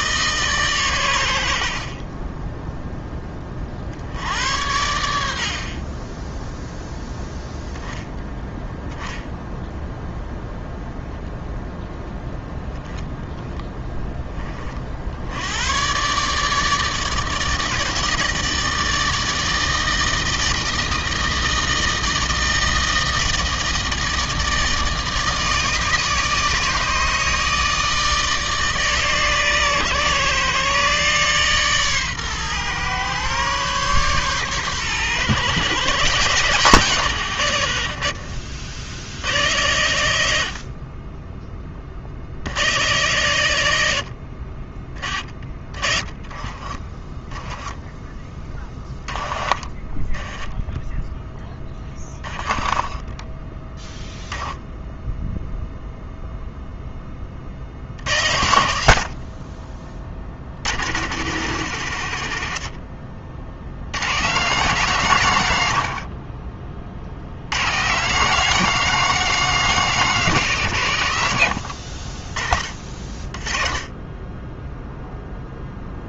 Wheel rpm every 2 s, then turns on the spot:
110, 10, 90, 0, 0, 0, 0, 40, 160, 160, 160, 160, 160, 160, 150, 140, 130, 130, 130, 70, 40, 100, 30, 20, 10, 10, 10, 0, 10, 80, 110, 70, 160, 70, 210, 140, 30, 0.
46-54